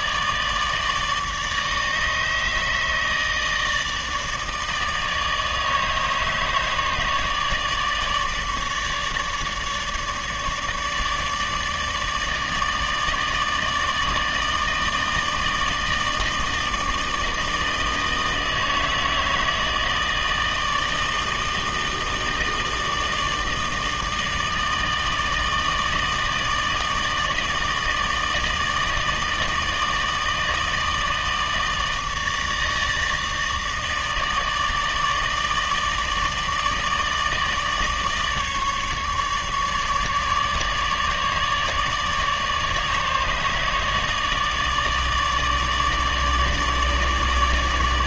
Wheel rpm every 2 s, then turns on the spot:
150, 150, 160, 150, 150, 150, 150, 160, 160, 160, 160, 160, 160, 160, 160, 160, 160, 160, 160, 150, 150, 150, 150, 150.
none